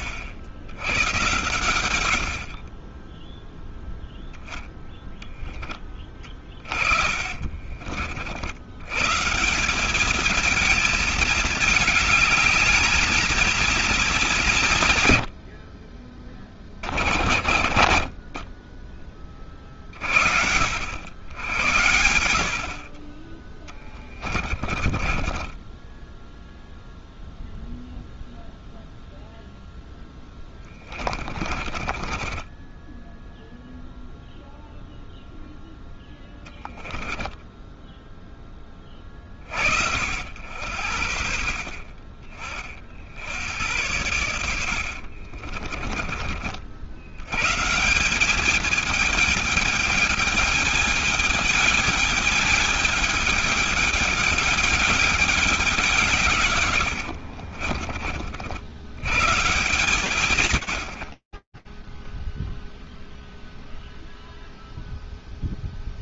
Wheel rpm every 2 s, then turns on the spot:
110, 10, 10, 40, 140, 220, 220, 110, 30, 20, 70, 40, 20, 0, 0, 20, 10, 0, 0, 10, 70, 40, 90, 60, 210, 210, 210, 210, 120, 80, 100, 0, 0.
6-8 24-26 30-34 44-46 56-58